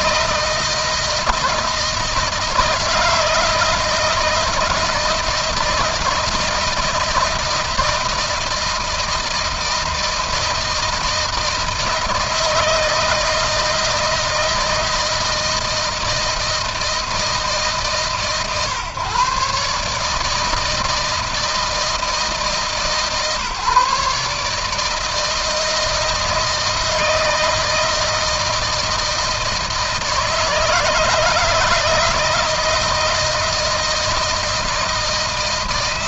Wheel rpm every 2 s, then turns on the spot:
160, 160, 160, 160, 160, 160, 160, 160, 160, 140, 160, 140, 160, 160, 160, 160, 160, 170.
none